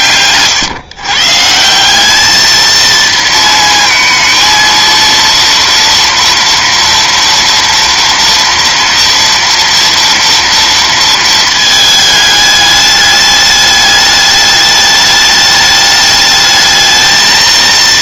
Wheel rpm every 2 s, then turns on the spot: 140, 230, 230, 230, 230, 220, 210, 210, 220.
none